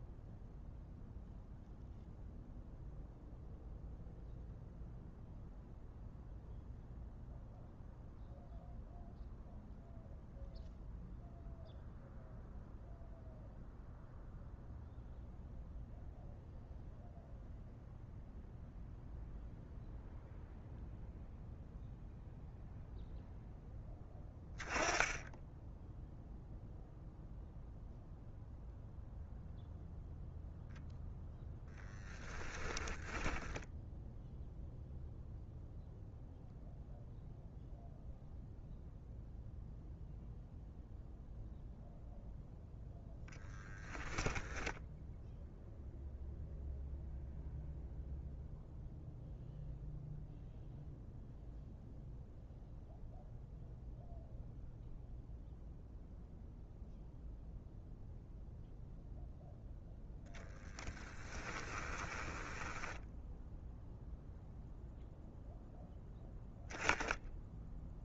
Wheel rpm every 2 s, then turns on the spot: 0, 0, 0, 0, 0, 0, 0, 0, 0, 0, 0, 0, 10, 0, 0, 0, 10, 0, 0, 0, 0, 0, 0, 0, 0, 0, 0, 0, 0, 0, 10, 10, 0, 0.
32-34 60-64